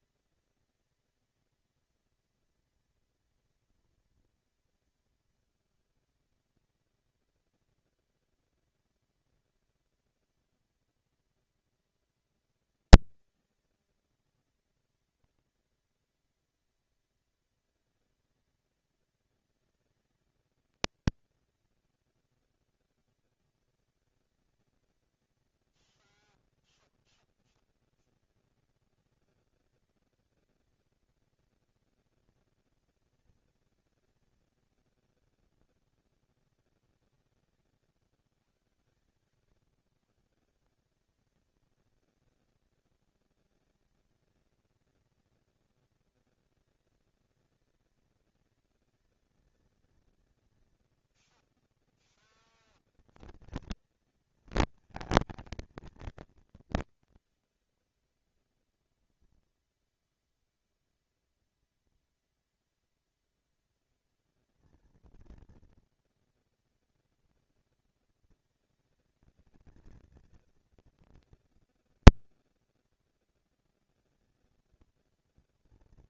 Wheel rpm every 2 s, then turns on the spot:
230, 230, 210, 210, 230, 230, 230, 230, 240, 230, 220, 230, 230, 230, 230, 240, 230, 220, 200, 140, 160, 220, 230, 230, 230, 230, 230, 230, 230, 240, 230, 230, 230, 230, 220, 230, 230, 230.
none